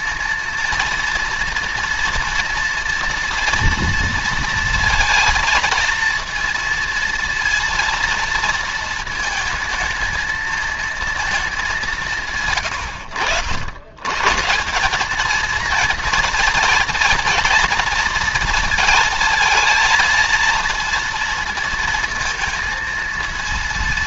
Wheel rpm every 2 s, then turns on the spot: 230, 230, 230, 230, 220, 230, 100, 180, 230, 220, 230, 230.
none